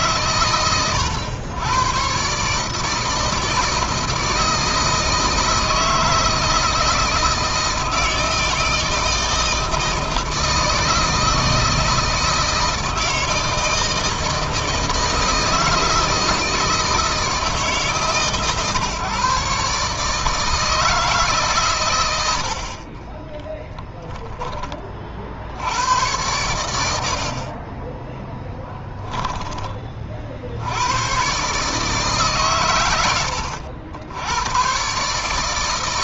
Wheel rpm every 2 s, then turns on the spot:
130, 150, 160, 160, 160, 160, 160, 160, 160, 140, 160, 60, 20, 90, 10, 70, 140, 110.
22-24 28-30